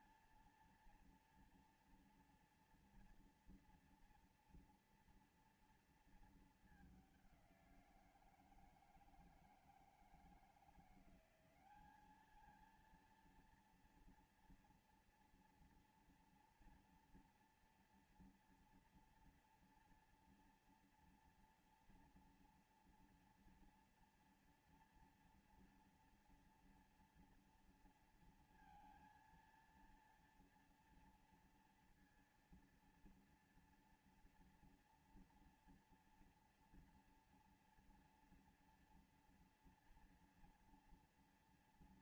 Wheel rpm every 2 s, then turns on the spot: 230, 230, 230, 200, 160, 180, 230, 230, 230, 230, 230, 230, 230, 230, 230, 230, 230, 230, 230, 230, 230.
none